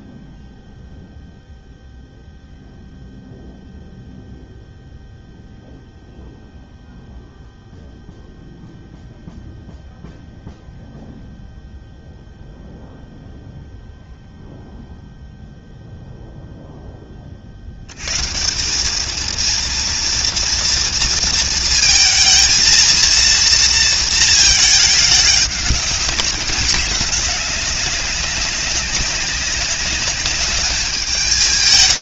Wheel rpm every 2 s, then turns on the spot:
0, 0, 0, 0, 0, 0, 0, 0, 0, 80, 230, 220, 230, 210, 200, 190.
none